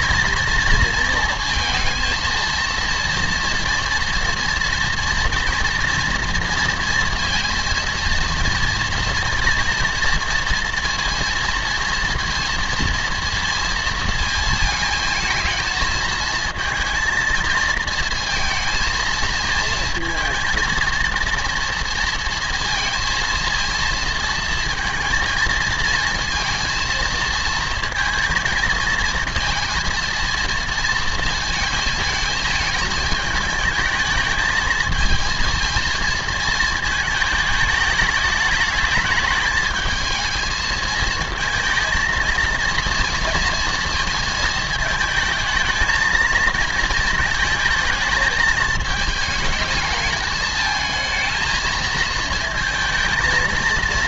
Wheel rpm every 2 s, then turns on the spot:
230, 230, 230, 230, 230, 230, 230, 220, 220, 220, 230, 230, 230, 230, 230, 230, 220, 220, 220, 210, 230, 230, 220, 220, 220, 220, 220.
none